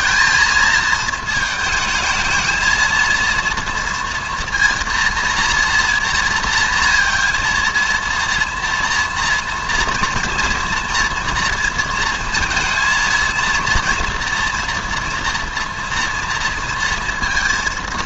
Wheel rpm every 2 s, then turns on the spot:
220, 220, 230, 230, 230, 230, 230, 230, 230.
none